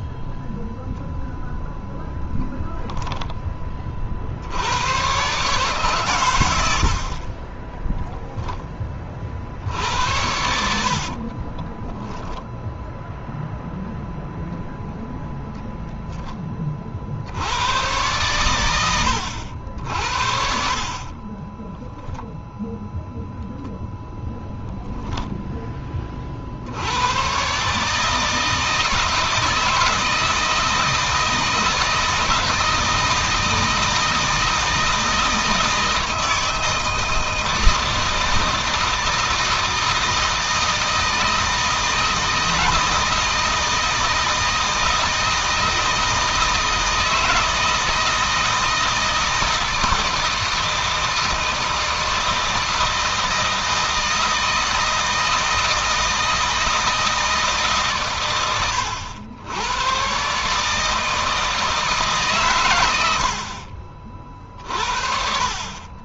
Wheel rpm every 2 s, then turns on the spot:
0, 10, 70, 90, 10, 70, 0, 0, 30, 100, 40, 0, 0, 60, 160, 160, 170, 160, 160, 160, 160, 160, 160, 160, 160, 160, 160, 160, 160, 100, 140, 120, 50.
10-12